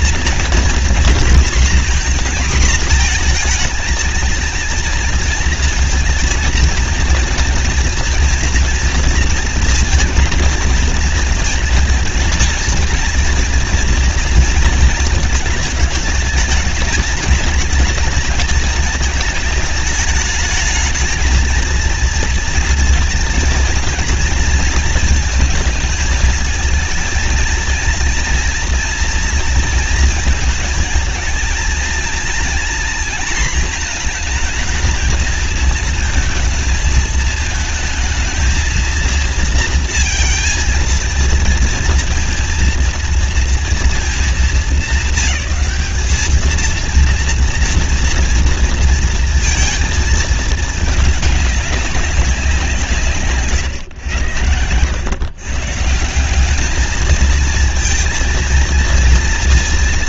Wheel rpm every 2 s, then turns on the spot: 230, 240, 230, 230, 230, 230, 230, 230, 210, 220, 210, 220, 220, 220, 230, 220, 230, 220, 220, 220, 230, 240, 210, 220, 230, 220, 170, 100, 210, 230.
none